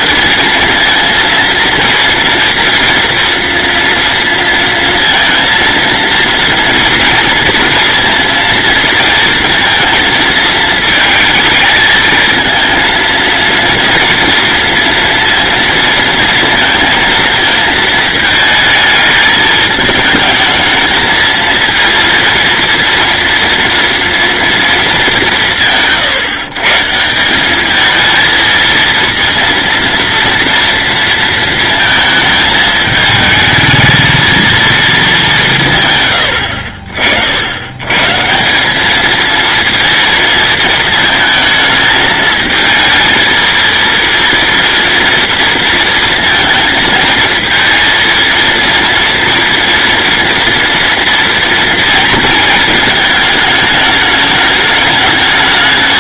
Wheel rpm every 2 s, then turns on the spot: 230, 230, 230, 230, 230, 220, 230, 230, 230, 220, 220, 230, 210, 150, 230, 230, 220, 230, 60, 200, 220, 220, 230, 220, 230, 230, 220, 210.
none